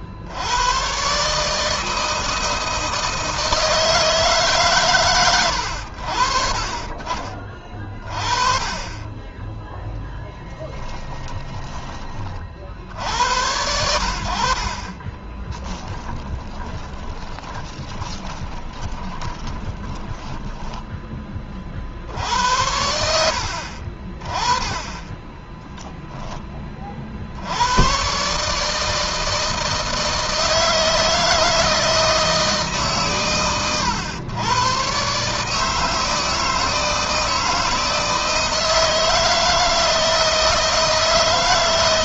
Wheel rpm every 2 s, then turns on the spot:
100, 160, 130, 40, 20, 10, 60, 40, 10, 20, 10, 80, 20, 20, 150, 160, 150, 120, 160, 160, 160.
10-12 14-22